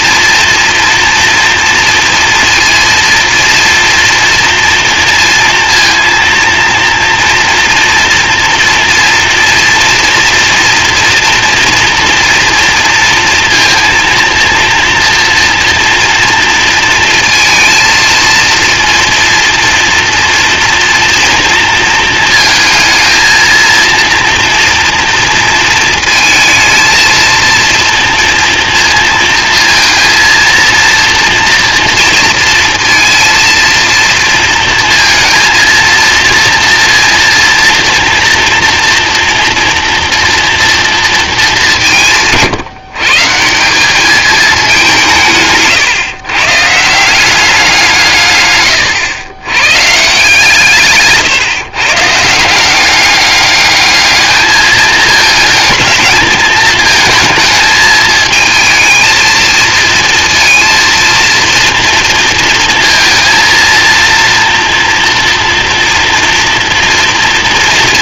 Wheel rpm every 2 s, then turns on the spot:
230, 230, 230, 230, 230, 230, 230, 230, 230, 230, 230, 220, 230, 220, 230, 230, 230, 230, 230, 230, 230, 140, 190, 150, 110, 160, 190, 220, 220, 220, 230, 230, 240, 240.
none